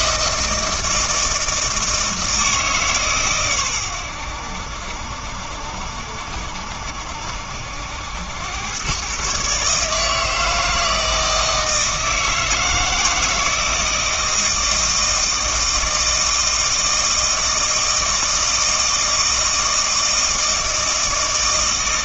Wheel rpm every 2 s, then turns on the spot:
160, 150, 70, 70, 110, 160, 160, 160, 160, 160, 160.
none